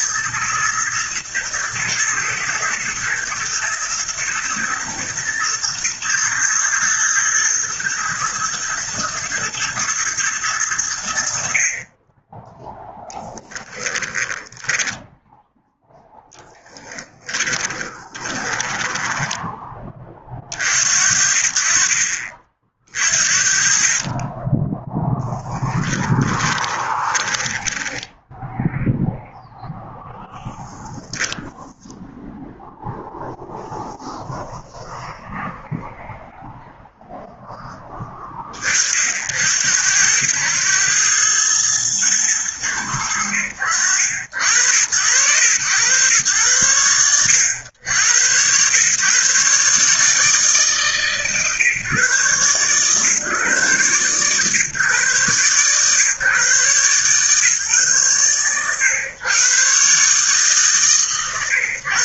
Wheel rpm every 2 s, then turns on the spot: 120, 110, 120, 120, 120, 70, 0, 10, 20, 10, 60, 50, 0, 20, 0, 0, 0, 0, 0, 50, 100, 90, 80, 100, 130, 140, 130, 130, 140, 130, 140.
16-20 26-28